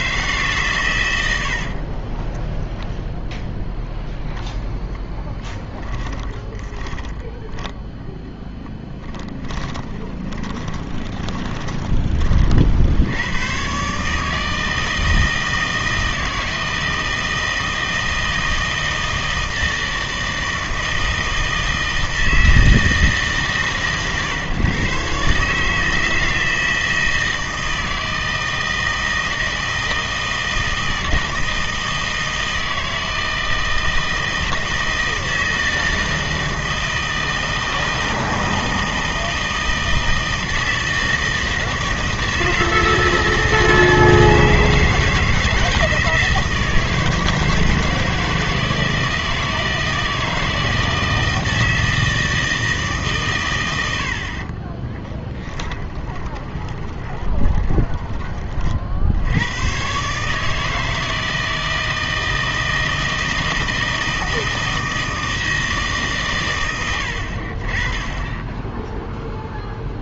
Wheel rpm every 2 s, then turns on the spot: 120, 0, 0, 20, 10, 20, 60, 160, 160, 160, 160, 160, 140, 160, 160, 160, 160, 160, 160, 160, 160, 160, 160, 160, 160, 160, 150, 20, 20, 50, 160, 160, 160, 90, 10.
6-12 54-58